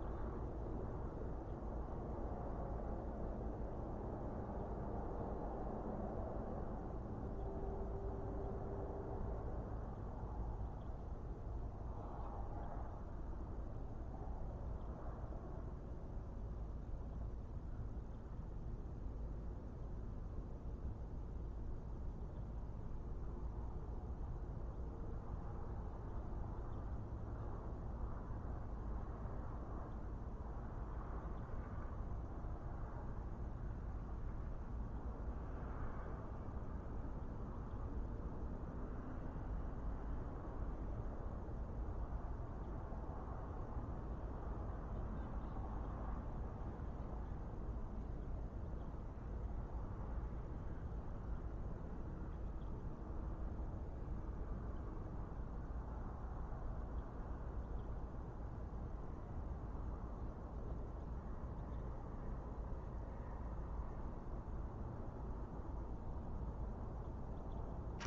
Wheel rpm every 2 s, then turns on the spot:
0, 0, 0, 0, 0, 0, 0, 0, 0, 0, 0, 0, 0, 0, 0, 0, 0, 0, 0, 0, 0, 0, 0, 0, 0, 0, 0, 0, 0, 0, 0, 0, 0, 0.
none